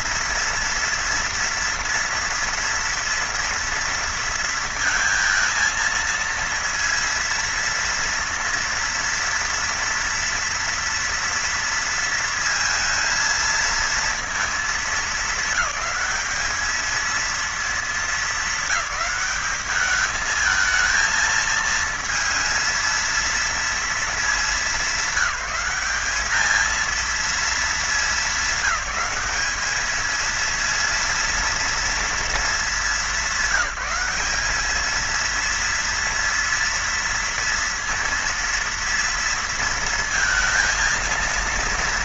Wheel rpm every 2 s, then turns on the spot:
230, 230, 230, 230, 230, 230, 220, 220, 220, 200, 220, 230, 200, 220, 200, 230, 210, 210, 230, 230, 220.
none